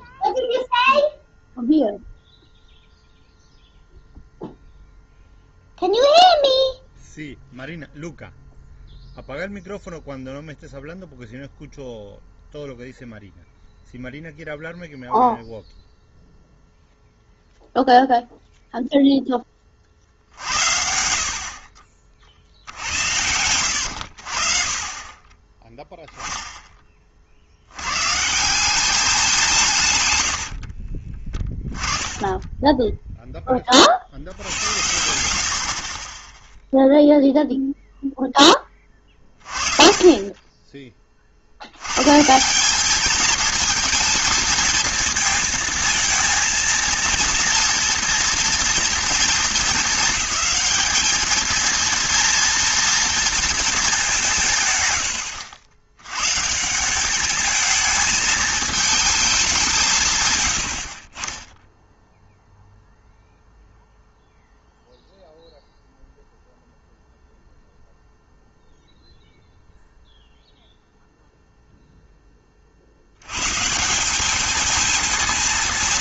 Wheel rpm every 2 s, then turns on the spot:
0, 0, 0, 0, 0, 0, 0, 0, 0, 0, 70, 80, 30, 20, 190, 60, 10, 80, 0, 20, 20, 190, 220, 230, 230, 210, 230, 140, 160, 220, 80, 0, 0, 0, 0, 0, 40, 220.
30-32